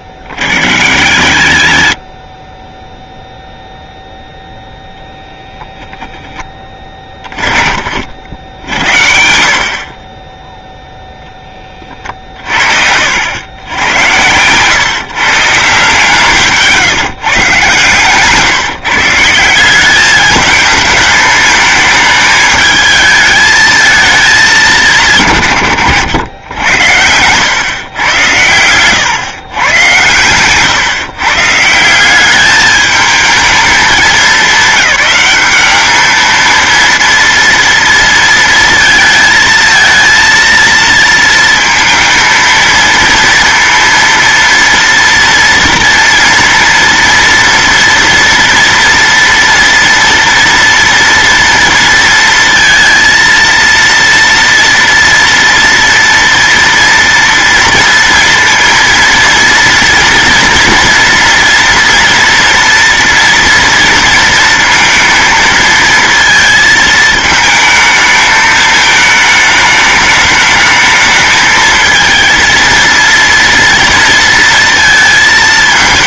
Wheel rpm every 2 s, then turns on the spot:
70, 10, 0, 10, 60, 0, 80, 150, 160, 150, 220, 220, 160, 90, 120, 130, 210, 200, 230, 220, 230, 230, 230, 230, 230, 230, 230, 230, 230, 230, 230, 230, 230, 220, 220, 220, 230, 230.
none